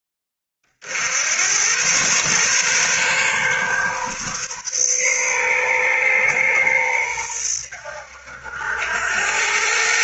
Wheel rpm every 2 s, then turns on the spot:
60, 130, 130, 110, 80.
none